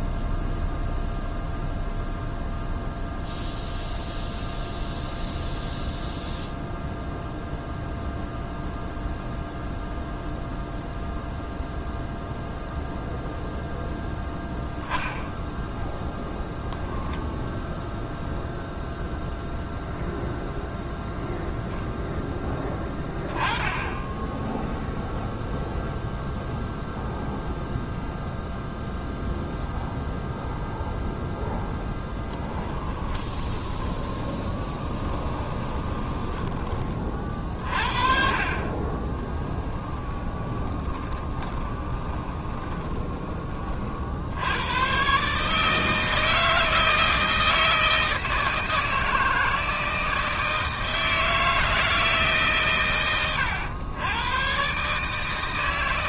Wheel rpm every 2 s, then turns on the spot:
0, 0, 0, 0, 0, 0, 0, 10, 0, 0, 0, 10, 0, 0, 0, 0, 20, 20, 30, 30, 20, 20, 120, 160, 160, 160, 100, 150.
32-36 38-44